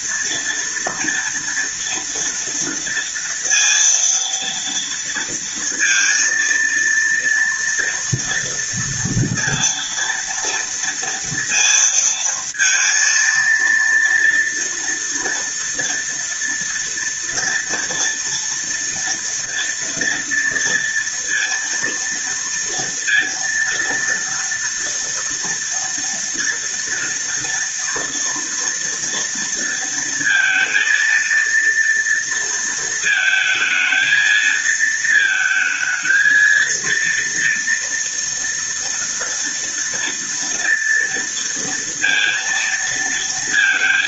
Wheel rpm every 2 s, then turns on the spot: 230, 230, 230, 230, 240, 230, 230, 230, 230, 230, 230, 230, 230, 230, 230, 230, 220, 220, 230, 230, 230, 230.
none